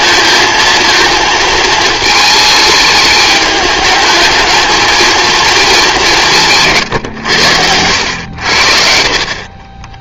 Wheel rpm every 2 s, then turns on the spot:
230, 210, 220, 150, 60.
none